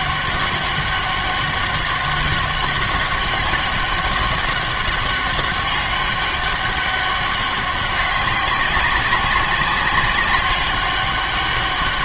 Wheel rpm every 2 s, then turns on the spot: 200, 190, 190, 200, 200, 200.
none